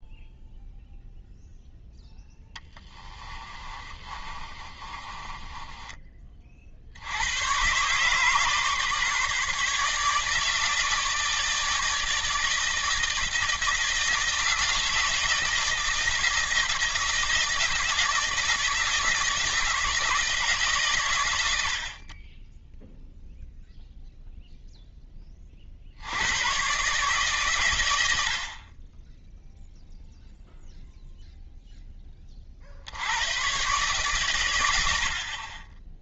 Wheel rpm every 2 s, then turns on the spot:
0, 10, 30, 80, 150, 150, 160, 160, 160, 160, 130, 0, 10, 140, 20, 0, 80, 90.
2-6